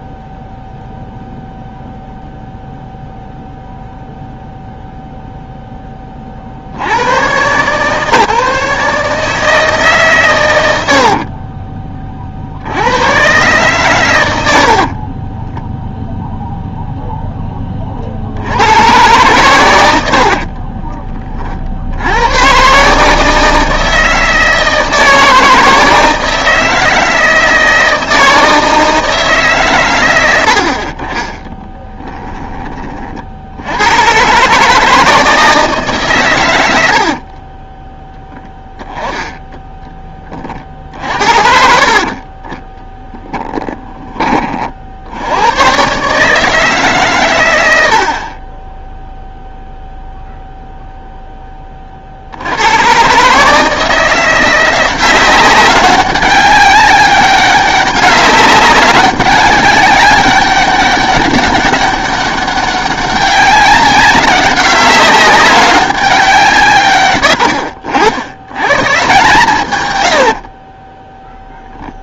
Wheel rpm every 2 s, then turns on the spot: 0, 0, 0, 50, 150, 80, 90, 40, 0, 110, 30, 140, 160, 160, 160, 50, 30, 160, 70, 10, 50, 10, 60, 150, 10, 0, 110, 180, 200, 200, 190, 200, 200, 120, 140, 20.
10-12 14-16 20-22 36-38 42-44 48-50